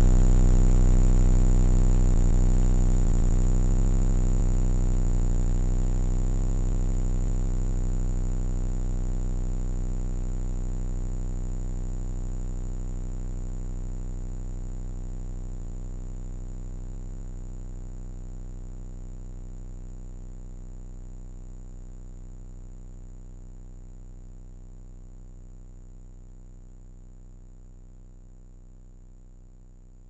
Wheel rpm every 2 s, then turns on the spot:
0, 10, 10, 10, 20, 20, 20, 20, 20, 30, 30, 30, 30, 30, 30.
none